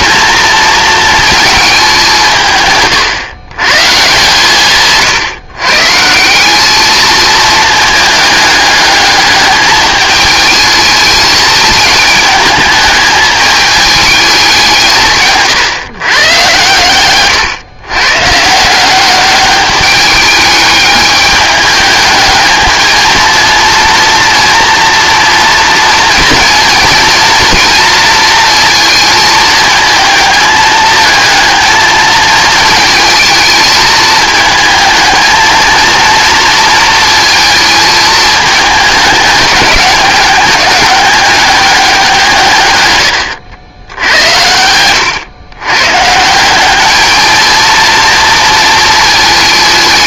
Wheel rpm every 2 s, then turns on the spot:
230, 150, 150, 200, 210, 220, 220, 170, 120, 160, 210, 220, 230, 230, 230, 220, 220, 220, 220, 220, 200, 130, 100, 200, 220.
none